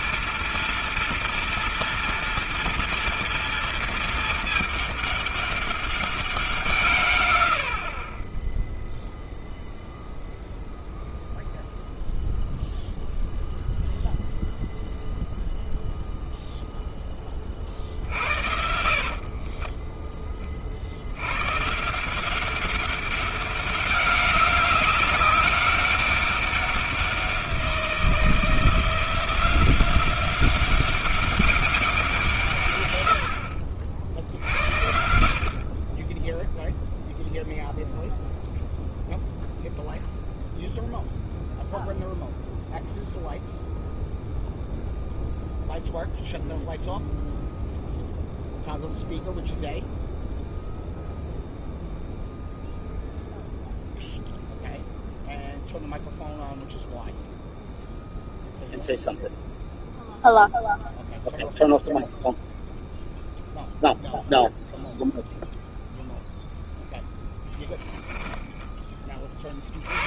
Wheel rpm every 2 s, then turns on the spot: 240, 230, 210, 150, 0, 0, 0, 0, 0, 50, 60, 190, 190, 190, 170, 190, 120, 70, 0, 0, 0, 0, 0, 0, 0, 0, 0, 0, 0, 0, 0, 0, 0, 0, 20.
18-20